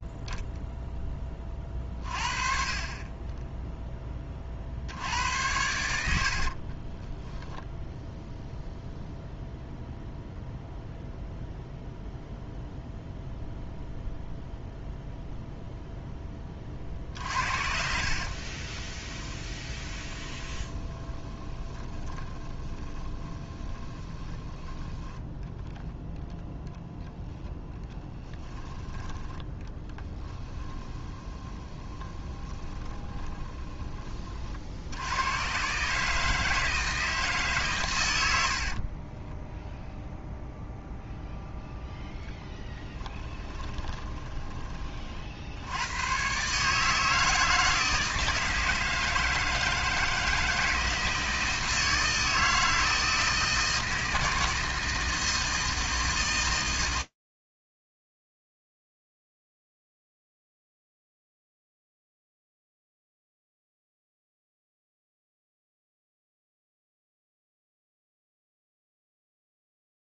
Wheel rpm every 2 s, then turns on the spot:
10, 20, 80, 20, 0, 0, 0, 0, 40, 10, 20, 20, 10, 0, 10, 20, 20, 90, 160, 30, 0, 10, 40, 160, 160, 160, 160, 160, 120, 40, 0, 0, 0, 0, 0.
6-8 16-24 30-34 38-40 42-44